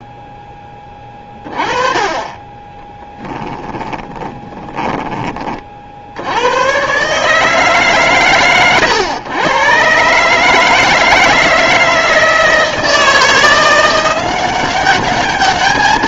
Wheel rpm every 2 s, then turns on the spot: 20, 10, 10, 120, 120, 160, 160, 190.
2-6